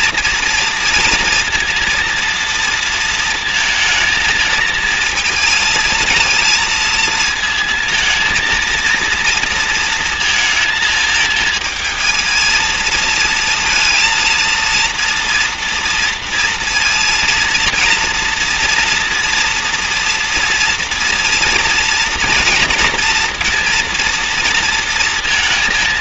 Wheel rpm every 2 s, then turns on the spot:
230, 230, 220, 230, 230, 230, 220, 230, 230, 230, 230, 230, 230.
none